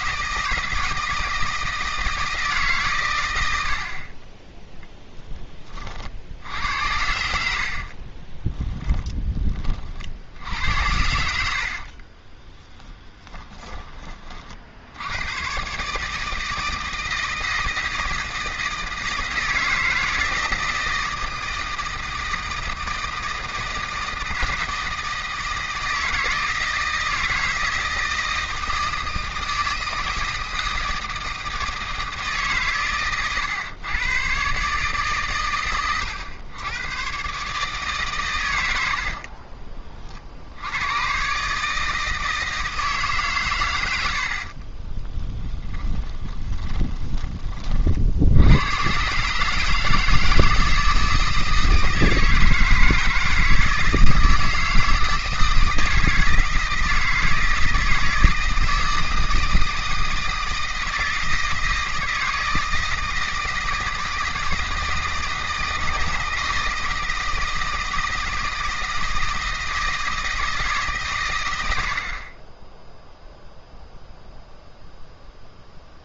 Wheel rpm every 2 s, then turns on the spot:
160, 140, 10, 80, 20, 80, 10, 80, 160, 160, 160, 160, 160, 160, 160, 160, 130, 140, 110, 70, 100, 160, 30, 20, 120, 160, 160, 160, 160, 160, 160, 160, 160, 160, 160, 150, 10, 0.
8-14 38-40 44-48